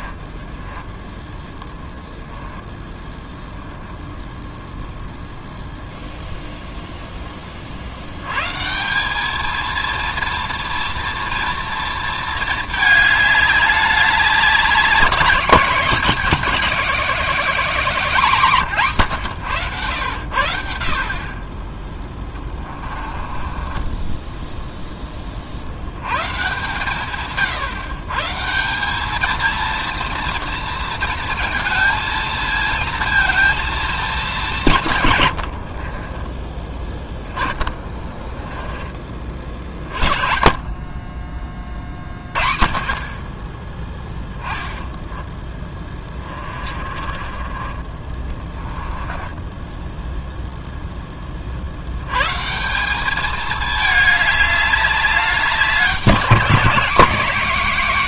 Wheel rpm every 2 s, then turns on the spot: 10, 10, 0, 0, 150, 230, 220, 200, 240, 170, 60, 20, 10, 150, 170, 230, 230, 160, 10, 10, 40, 40, 10, 30, 20, 0, 180, 210, 210.
0-4 22-24 38-40 44-50